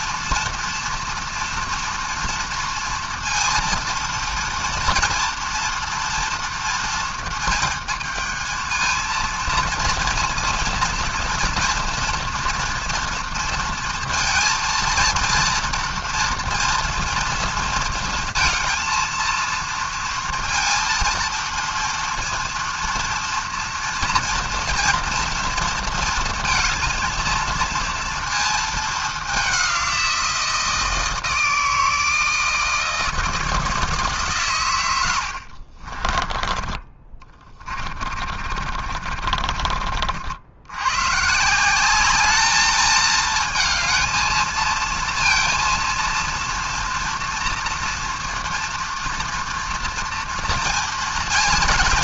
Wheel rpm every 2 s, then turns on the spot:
230, 230, 230, 230, 220, 230, 230, 230, 230, 230, 230, 230, 230, 230, 220, 170, 160, 120, 20, 40, 80, 210, 230, 230, 240, 230.
36-40